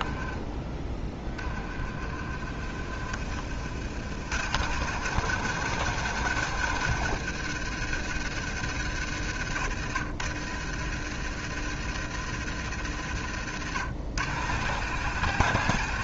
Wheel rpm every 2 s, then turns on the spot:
20, 40, 120, 120, 90, 80, 70, 110.
none